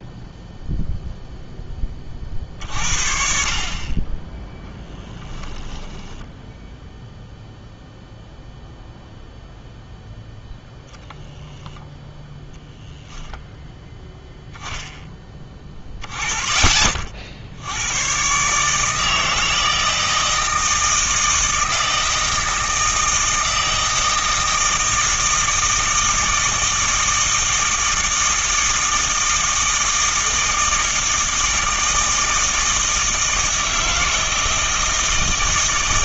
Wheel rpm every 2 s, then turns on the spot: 0, 50, 10, 0, 0, 0, 10, 0, 30, 140, 160, 160, 160, 160, 160, 160, 160, 160.
none